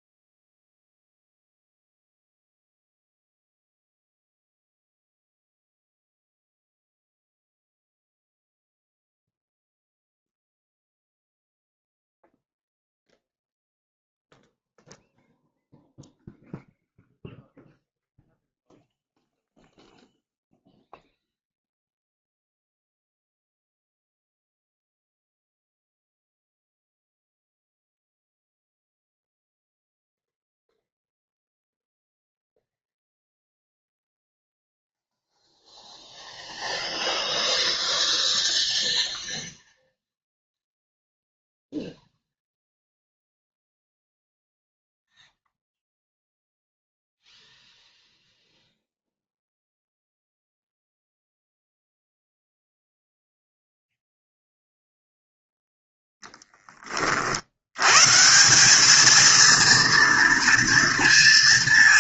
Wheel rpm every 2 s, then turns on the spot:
0, 0, 0, 0, 0, 0, 0, 0, 0, 0, 0, 0, 0, 0, 0, 0, 0, 0, 0, 0, 0, 0, 0, 0, 0, 0, 0, 0, 10, 190, 230.
none